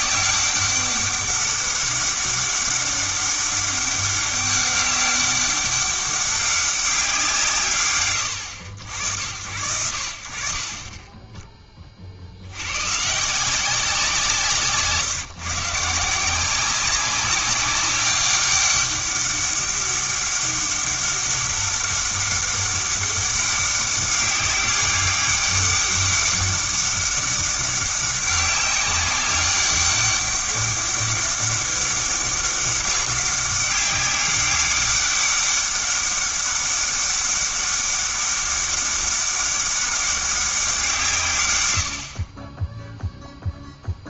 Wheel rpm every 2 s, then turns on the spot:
200, 200, 200, 190, 80, 30, 120, 150, 190, 200, 200, 190, 200, 200, 190, 200, 200, 200, 200, 200, 170, 0.
none